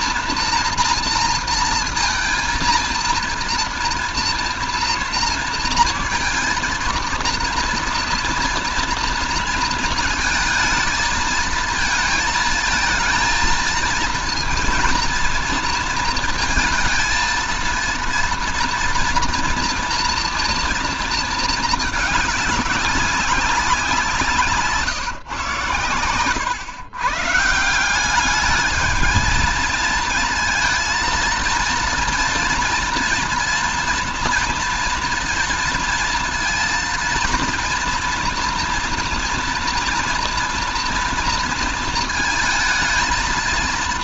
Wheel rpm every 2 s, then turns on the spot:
240, 230, 230, 230, 240, 220, 230, 230, 230, 230, 230, 200, 150, 130, 210, 230, 230, 230, 230, 230, 240, 220.
none